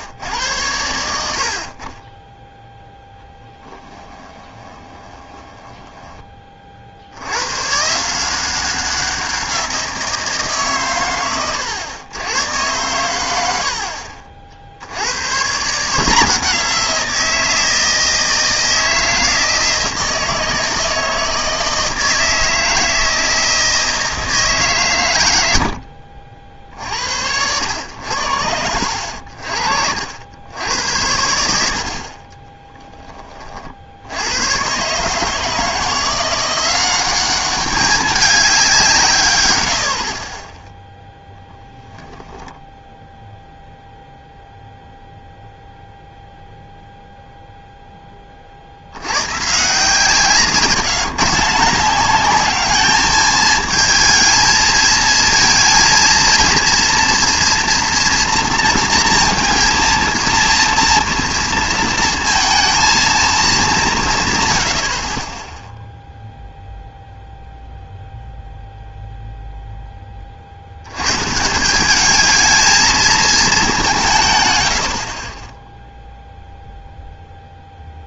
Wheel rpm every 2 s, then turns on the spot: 90, 0, 20, 50, 190, 130, 110, 60, 170, 160, 160, 160, 140, 60, 80, 80, 10, 130, 190, 170, 10, 0, 0, 0, 60, 160, 210, 220, 230, 230, 230, 230, 70, 0, 0, 80, 220, 80, 0.
4-6